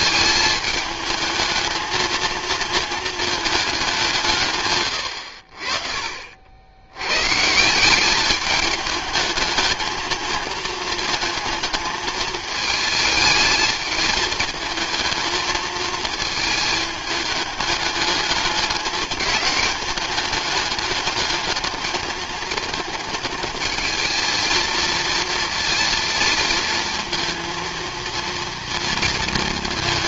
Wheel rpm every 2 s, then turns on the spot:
210, 220, 130, 70, 210, 220, 220, 220, 220, 210, 210, 220, 220, 230, 230.
none